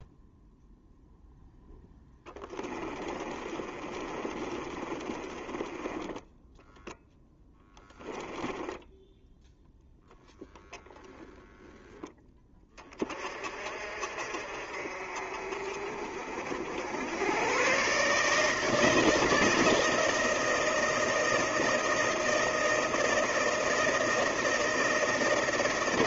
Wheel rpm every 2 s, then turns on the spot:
0, 30, 30, 0, 0, 10, 30, 50, 90, 160, 160, 160, 160.
2-6